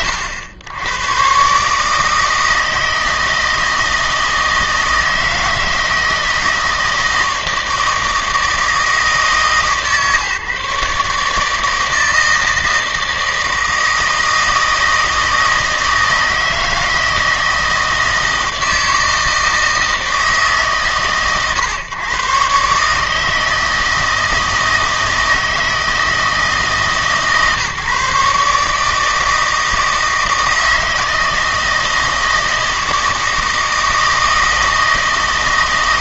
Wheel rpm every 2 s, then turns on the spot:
90, 160, 160, 160, 150, 140, 160, 160, 160, 160, 130, 140, 160, 150, 150, 160, 160, 160.
none